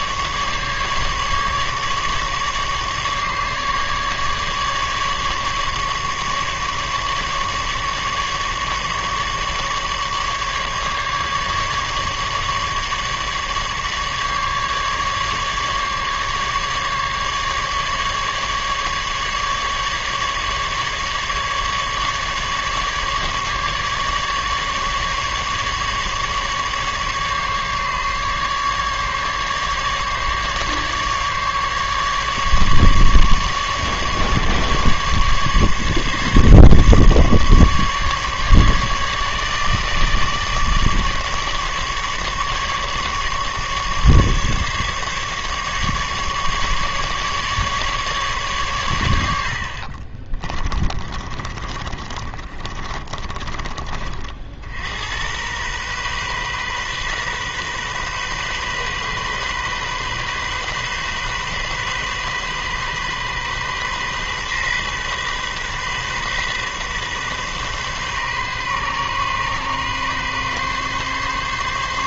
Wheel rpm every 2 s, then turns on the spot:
150, 150, 150, 150, 150, 150, 150, 150, 150, 150, 150, 150, 150, 150, 150, 150, 150, 140, 150, 150, 150, 150, 150, 150, 130, 30, 30, 60, 130, 130, 130, 130, 130, 130, 130, 140.
50-54